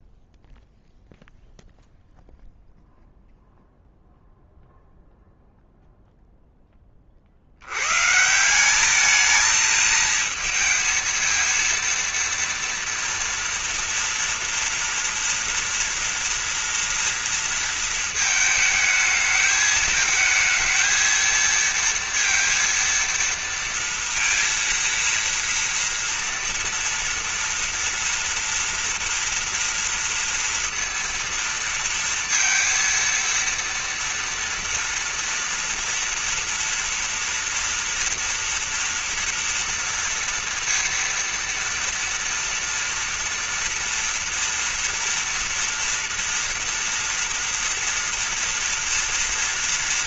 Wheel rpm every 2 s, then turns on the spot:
0, 0, 0, 0, 150, 220, 230, 230, 230, 220, 220, 230, 230, 240, 230, 230, 230, 230, 230, 230, 240, 230, 230, 230, 230.
none